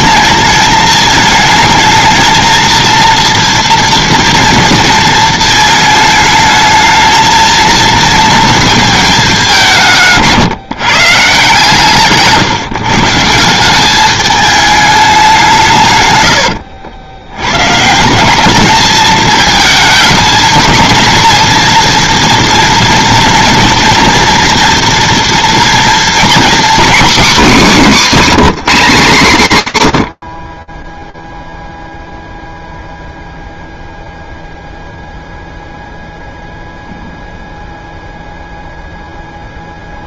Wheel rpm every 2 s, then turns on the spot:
220, 230, 230, 220, 220, 160, 160, 210, 90, 210, 220, 240, 230, 270, 210, 10, 0, 0, 0, 0.
none